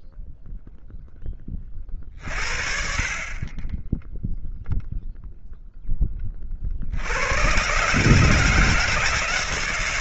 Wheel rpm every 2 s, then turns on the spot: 0, 40, 0, 80, 160.
none